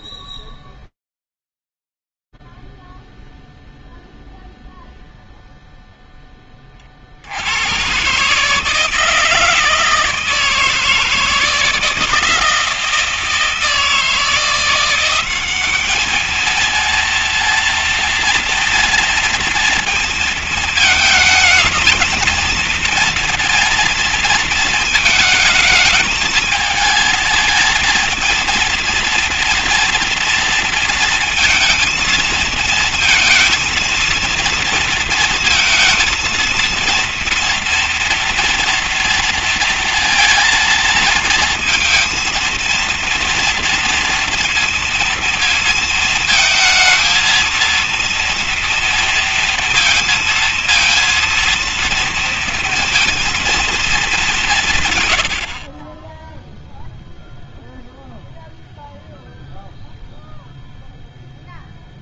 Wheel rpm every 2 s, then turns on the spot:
0, 0, 0, 0, 110, 160, 160, 160, 200, 230, 230, 230, 230, 220, 230, 230, 230, 230, 230, 230, 230, 230, 230, 220, 230, 230, 230, 210, 30, 0, 0.
none